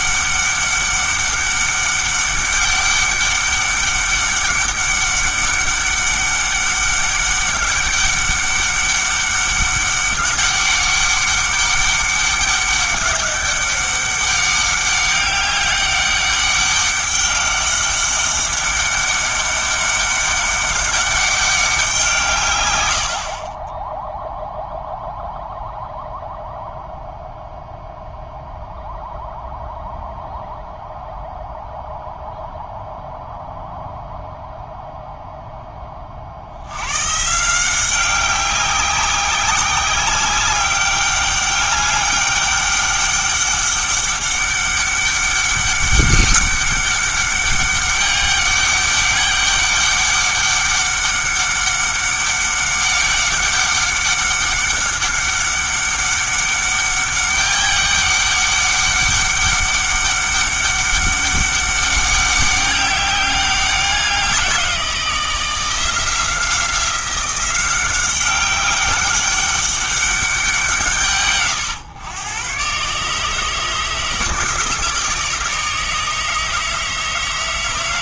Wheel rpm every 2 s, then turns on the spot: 200, 200, 200, 200, 200, 200, 190, 200, 200, 200, 200, 110, 0, 0, 0, 0, 0, 0, 100, 190, 200, 200, 200, 200, 200, 200, 200, 190, 200, 200, 200, 200, 180, 170, 200, 170, 130, 160, 160.
none